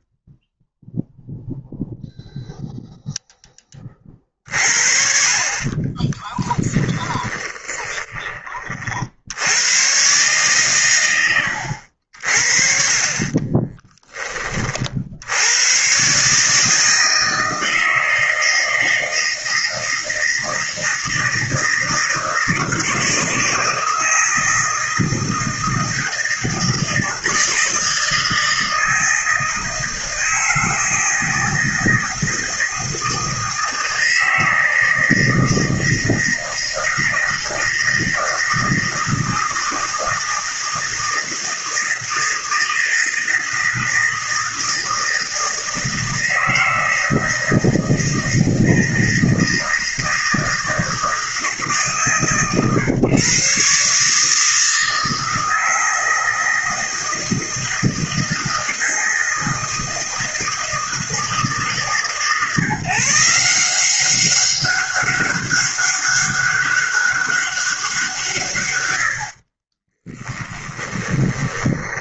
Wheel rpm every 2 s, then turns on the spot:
0, 0, 50, 20, 60, 110, 40, 60, 160, 160, 160, 160, 160, 160, 160, 160, 160, 160, 160, 160, 160, 160, 160, 160, 160, 160, 140, 160, 160, 160, 160, 160, 200, 200, 90, 10.
6-8 12-14 70-72